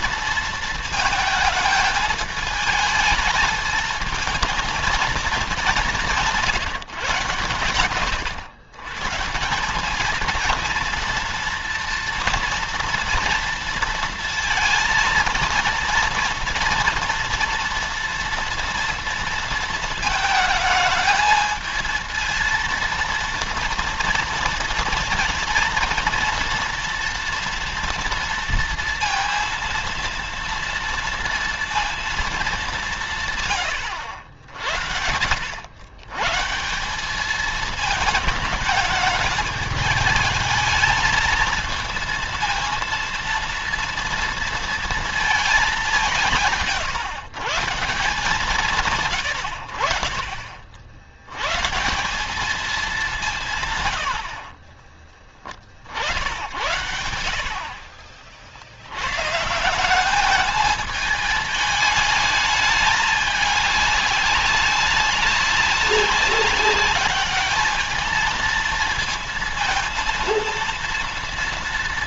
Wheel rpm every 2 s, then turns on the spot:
220, 220, 230, 150, 140, 230, 230, 230, 230, 230, 220, 230, 230, 240, 230, 230, 180, 70, 190, 220, 220, 230, 230, 150, 130, 70, 200, 20, 80, 100, 220, 210, 200, 200, 220, 230.
54-56